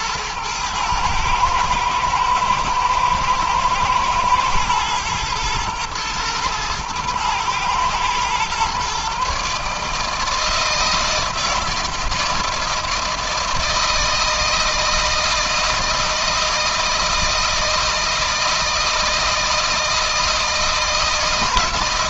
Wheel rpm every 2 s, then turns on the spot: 110, 110, 110, 110, 130, 160, 160, 160, 160, 160, 170.
none